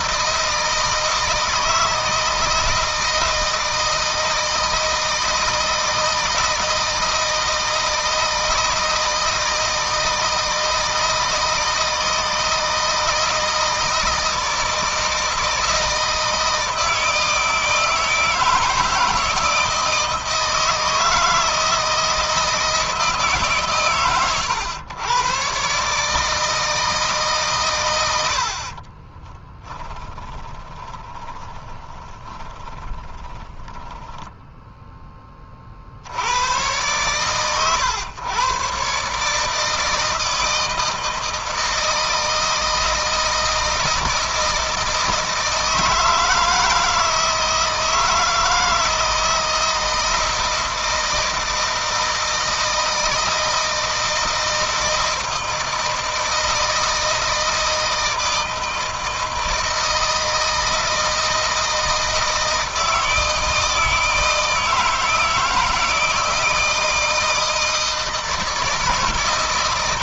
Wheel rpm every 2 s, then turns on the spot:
160, 160, 160, 160, 160, 160, 160, 160, 160, 160, 160, 160, 110, 160, 40, 20, 20, 10, 110, 130, 160, 160, 160, 160, 160, 160, 160, 160, 160, 160, 160, 160, 160, 160, 160.
28-34